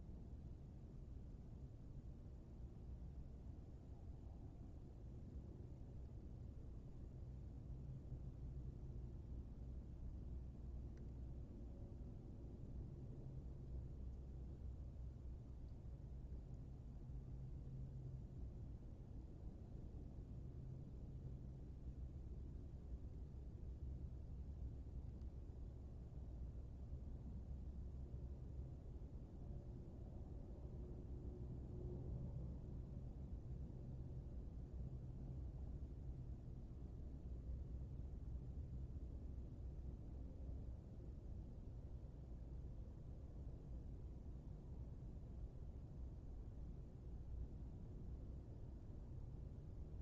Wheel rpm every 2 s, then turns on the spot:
0, 0, 0, 0, 0, 0, 0, 0, 0, 0, 0, 0, 0, 0, 0, 0, 0, 0, 0, 0, 0, 0, 0, 0, 0.
none